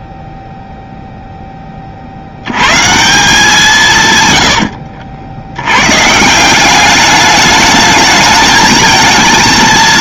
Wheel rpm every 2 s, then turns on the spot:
0, 110, 90, 190, 220.
4-6